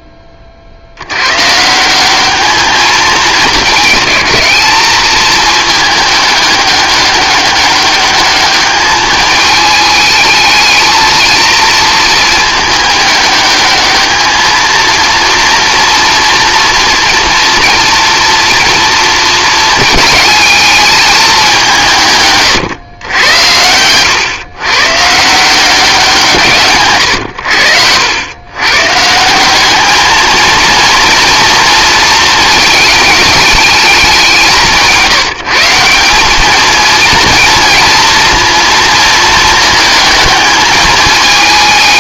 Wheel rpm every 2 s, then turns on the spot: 50, 210, 210, 200, 210, 220, 210, 220, 230, 230, 220, 130, 130, 130, 140, 230, 210, 170, 220, 230, 220.
none